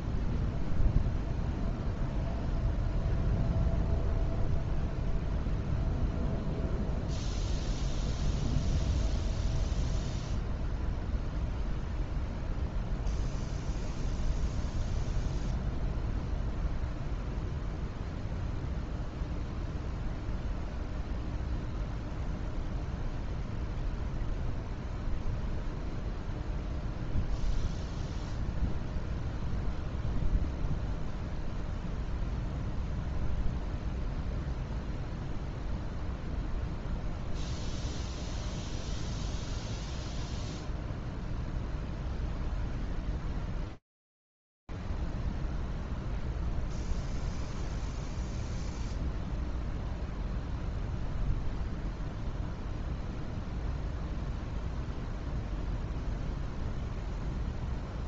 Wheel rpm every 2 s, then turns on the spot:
0, 0, 0, 0, 0, 0, 0, 0, 0, 0, 0, 0, 0, 0, 0, 0, 0, 0, 0, 0, 0, 0, 0, 0, 0, 0, 0, 0, 0.
none